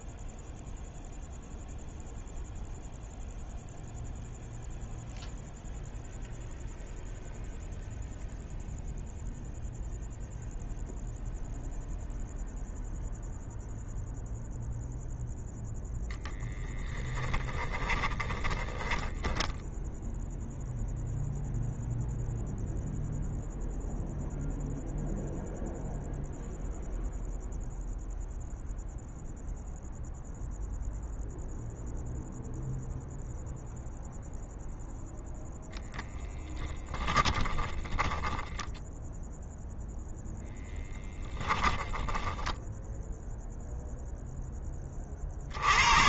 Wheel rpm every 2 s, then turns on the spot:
0, 0, 0, 0, 0, 0, 0, 0, 10, 10, 0, 0, 0, 0, 0, 0, 0, 0, 10, 0, 10, 10, 40.
18-20 36-38 40-44